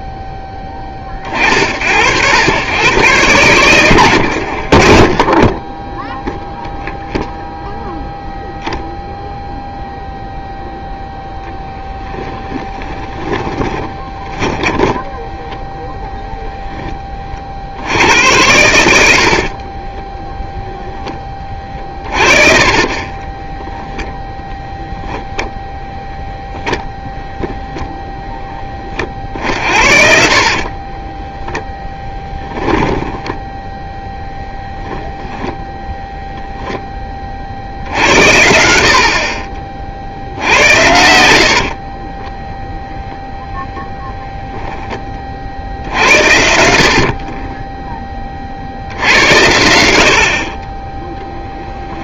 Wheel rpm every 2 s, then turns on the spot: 30, 110, 40, 0, 0, 0, 20, 10, 30, 60, 20, 20, 0, 0, 40, 10, 0, 10, 20, 40, 80, 0, 10, 50, 80, 20.
4-6 12-16 18-20 22-24 30-32 40-42 46-48 50-52